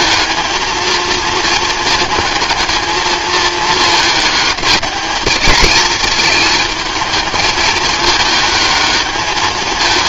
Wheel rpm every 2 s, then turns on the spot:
230, 220, 210, 220, 210.
none